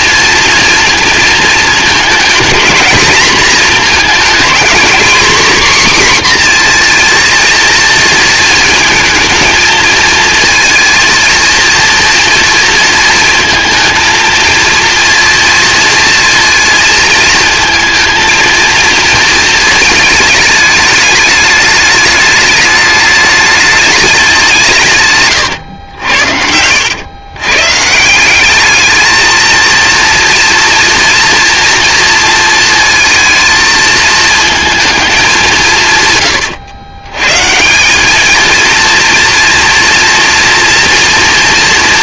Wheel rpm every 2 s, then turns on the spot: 230, 220, 230, 250, 230, 230, 230, 230, 230, 230, 210, 210, 180, 80, 200, 230, 230, 220, 120, 220, 230.
none